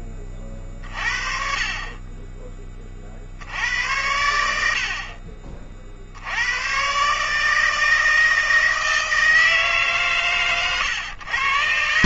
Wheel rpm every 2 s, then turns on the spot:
30, 40, 80, 110, 160, 110.
none